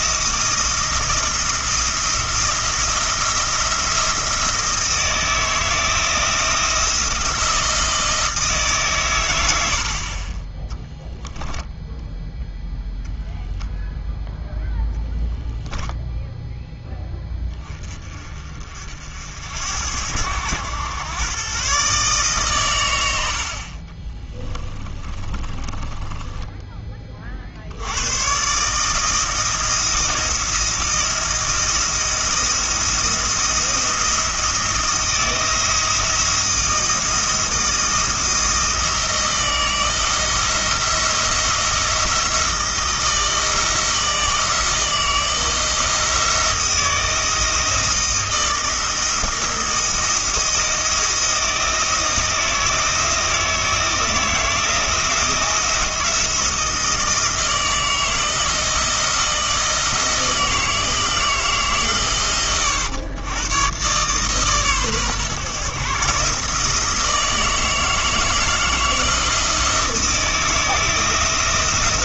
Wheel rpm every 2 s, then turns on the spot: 170, 170, 170, 170, 150, 10, 0, 0, 10, 50, 100, 130, 20, 20, 140, 170, 170, 170, 160, 160, 170, 160, 160, 170, 170, 170, 160, 170, 170, 160, 160, 100, 130, 160, 160, 160.
24-26